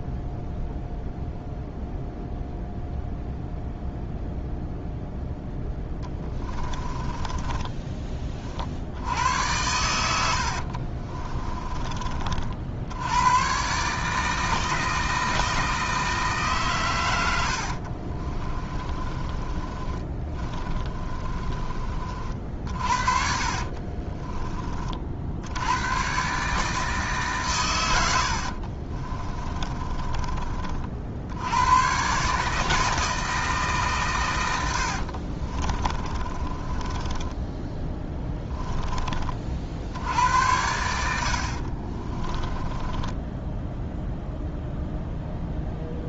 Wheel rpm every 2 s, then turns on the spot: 0, 0, 0, 20, 70, 50, 80, 160, 120, 20, 30, 50, 30, 150, 40, 50, 160, 80, 20, 20, 80, 20, 0.
6-8 10-12 18-24 28-30 34-38 42-44